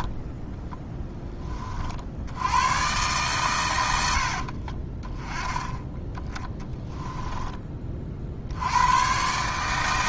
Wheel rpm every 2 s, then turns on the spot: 10, 120, 20, 10, 100.
0-2 6-8